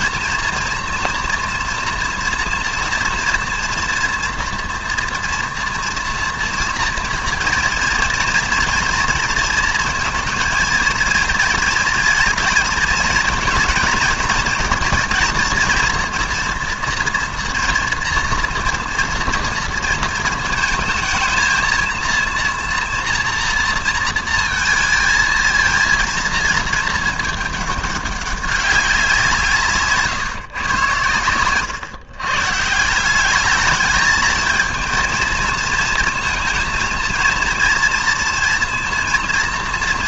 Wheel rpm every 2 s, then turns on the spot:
230, 240, 240, 240, 230, 230, 220, 230, 230, 230, 220, 230, 230, 220, 200, 130, 150, 220, 230, 230.
none